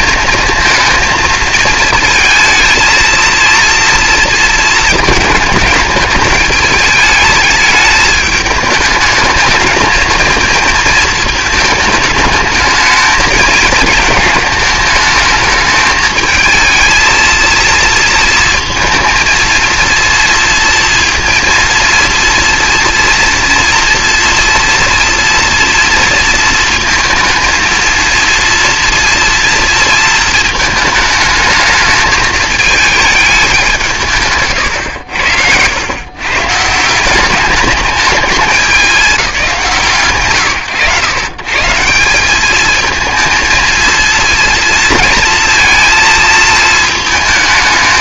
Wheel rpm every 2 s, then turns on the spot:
230, 220, 220, 220, 210, 220, 210, 220, 220, 230, 230, 230, 230, 220, 230, 220, 210, 120, 160, 210, 130, 220, 230, 220.
none